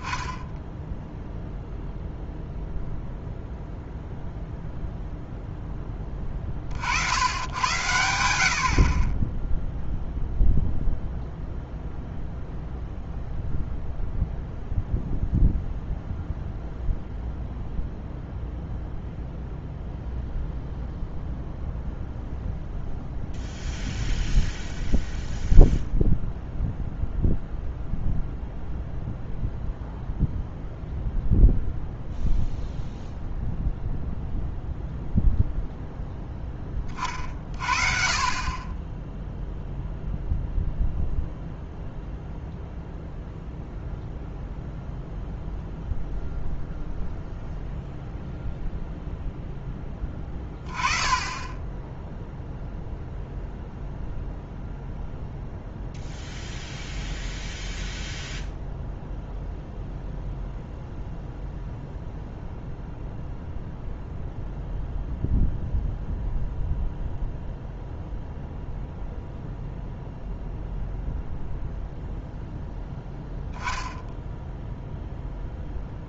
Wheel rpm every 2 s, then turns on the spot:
0, 0, 0, 70, 50, 0, 0, 0, 0, 0, 0, 0, 0, 0, 0, 0, 0, 0, 30, 20, 0, 0, 0, 0, 0, 20, 0, 0, 0, 0, 0, 0, 0, 0, 0, 0, 0, 0.
none